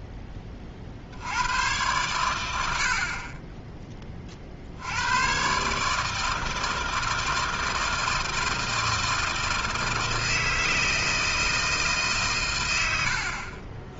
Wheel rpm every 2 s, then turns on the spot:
20, 100, 50, 160, 160, 160, 160.
none